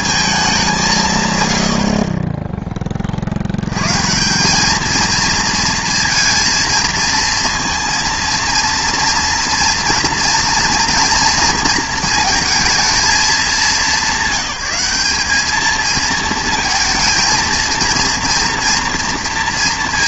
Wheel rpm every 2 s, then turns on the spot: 200, 20, 200, 230, 230, 240, 220, 200, 230, 230.
none